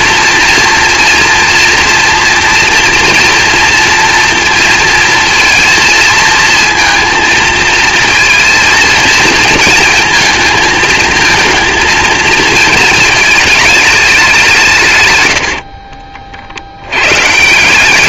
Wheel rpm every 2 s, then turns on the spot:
230, 230, 230, 230, 230, 220, 220, 170, 60.
none